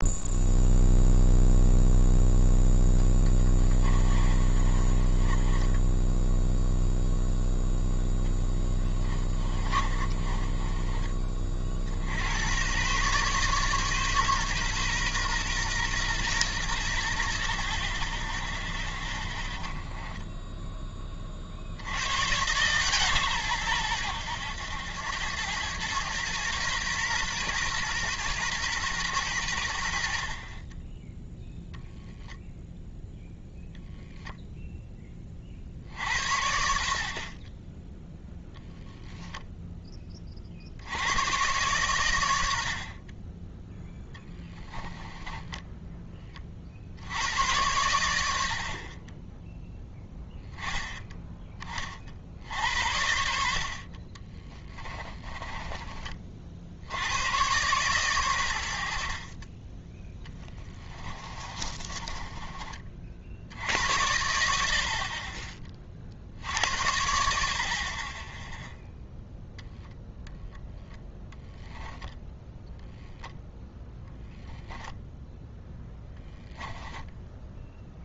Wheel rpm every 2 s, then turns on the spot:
0, 0, 30, 0, 10, 20, 110, 130, 100, 10, 10, 140, 90, 120, 120, 20, 0, 0, 60, 0, 70, 60, 10, 50, 50, 10, 70, 20, 70, 80, 20, 30, 60, 70, 0, 0, 10, 0, 10.
4-6 8-12 44-46 54-56 60-62 76-78